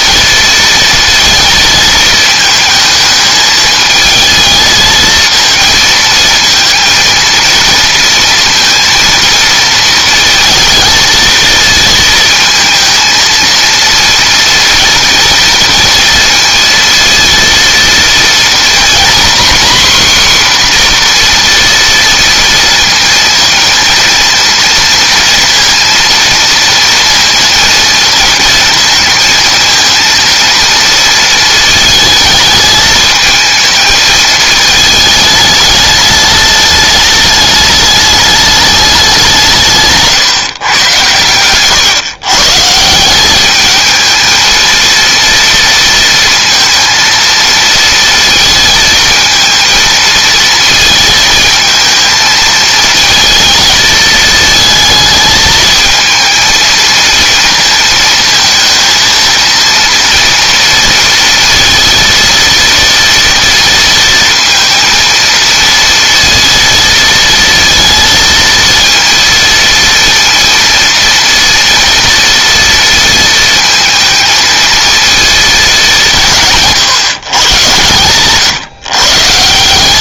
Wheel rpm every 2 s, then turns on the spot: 230, 220, 220, 230, 230, 220, 230, 230, 230, 240, 250, 230, 230, 230, 230, 230, 220, 220, 210, 200, 120, 160, 230, 230, 230, 220, 220, 220, 230, 230, 230, 230, 230, 230, 230, 230, 230, 230, 140, 140.
none